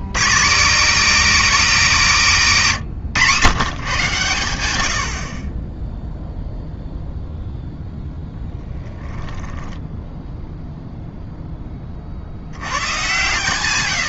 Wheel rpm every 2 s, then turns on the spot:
230, 190, 100, 0, 10, 0, 60.
none